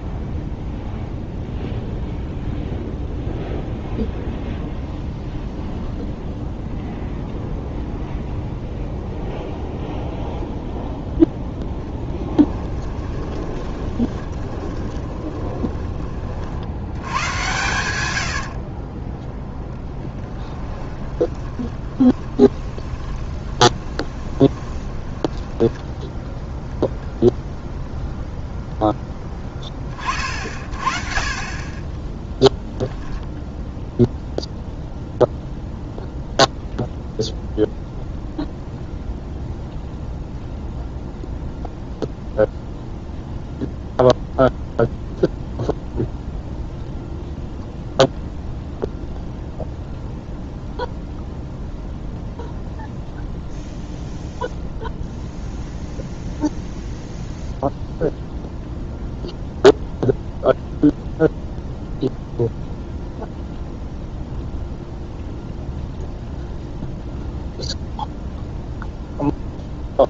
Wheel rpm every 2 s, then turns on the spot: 0, 0, 0, 0, 0, 0, 10, 20, 80, 30, 10, 30, 20, 0, 20, 30, 0, 0, 0, 0, 0, 0, 0, 0, 0, 0, 0, 0, 0, 0, 0, 0, 0, 0, 0.
12-16 18-26